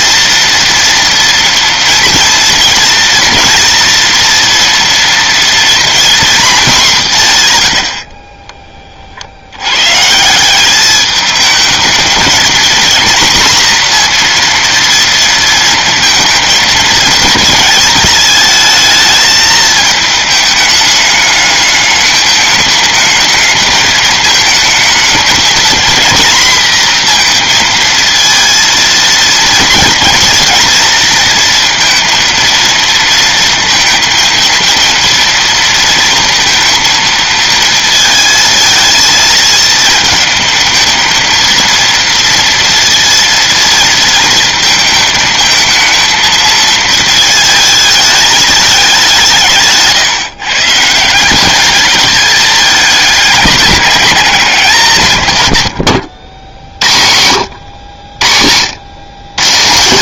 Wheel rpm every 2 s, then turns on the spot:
230, 230, 240, 50, 130, 220, 240, 230, 220, 220, 210, 210, 230, 230, 230, 230, 230, 230, 220, 220, 230, 230, 220, 220, 130, 210, 200, 80, 70, 100.
none